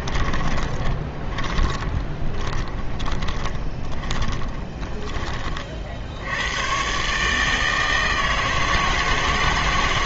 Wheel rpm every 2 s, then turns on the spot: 20, 20, 20, 120, 160.
0-6